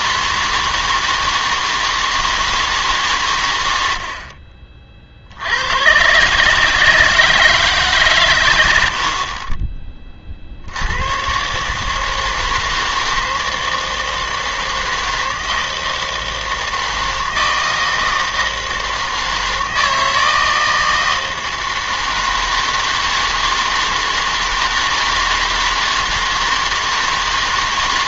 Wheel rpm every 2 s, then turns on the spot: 160, 160, 40, 150, 100, 70, 160, 160, 160, 160, 160, 160, 160, 160.
none